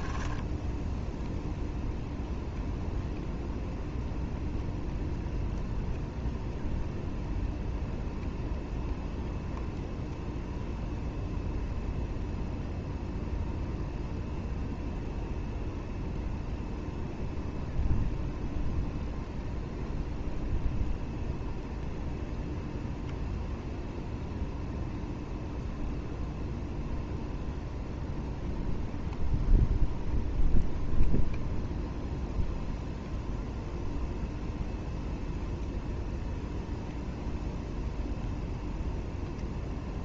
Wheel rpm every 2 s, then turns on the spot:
0, 0, 0, 0, 0, 0, 0, 0, 0, 0, 0, 0, 0, 0, 0, 0, 0, 0, 0, 0.
none